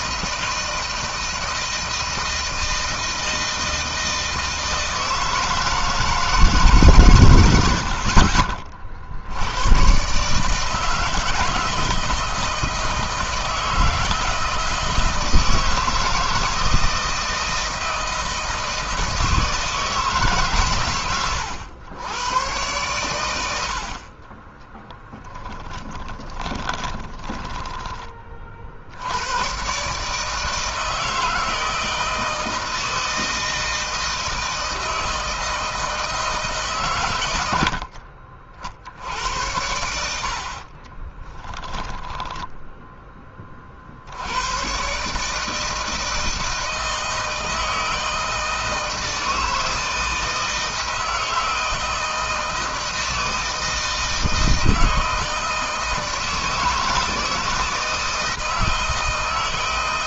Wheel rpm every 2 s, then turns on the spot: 160, 160, 160, 140, 60, 160, 160, 160, 160, 160, 110, 110, 10, 10, 80, 160, 160, 160, 120, 70, 20, 10, 120, 160, 160, 160, 160, 160, 160, 160.
24-28 40-42